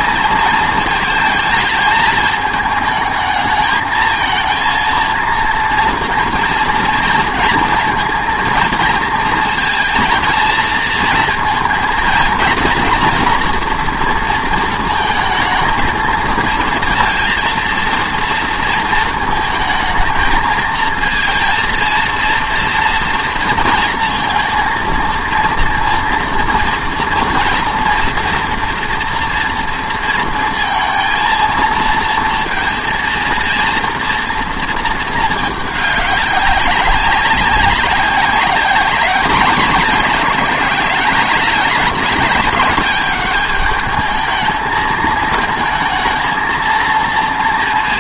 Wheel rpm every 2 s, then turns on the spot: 230, 220, 230, 230, 230, 230, 230, 230, 220, 230, 220, 230, 230, 240, 230, 230, 230, 230, 190, 200, 210, 200, 220, 230.
none